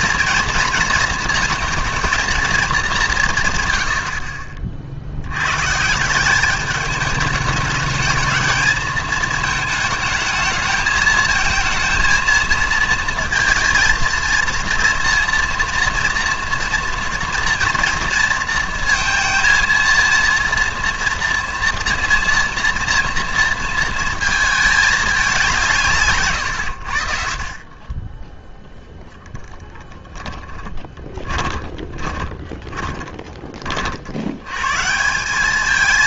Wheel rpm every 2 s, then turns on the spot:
230, 210, 40, 200, 220, 220, 220, 230, 240, 230, 230, 230, 220, 110, 0, 20, 20, 130.
30-34